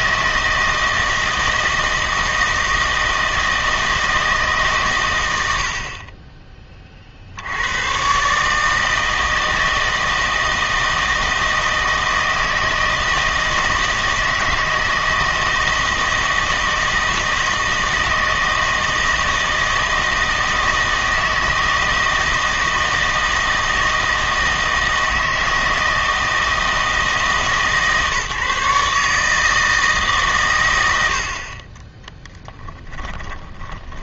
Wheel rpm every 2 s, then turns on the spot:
160, 160, 140, 30, 160, 160, 160, 160, 160, 160, 160, 160, 160, 160, 140, 100, 20.
32-34